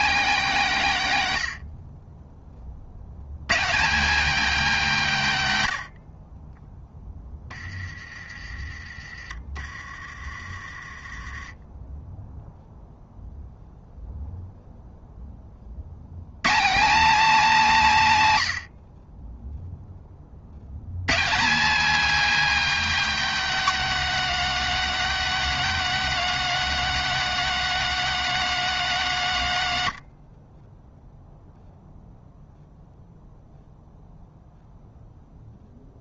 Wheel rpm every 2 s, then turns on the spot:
180, 40, 230, 20, 30, 30, 0, 0, 190, 120, 100, 270, 240, 230, 220, 20, 0, 0.
30-32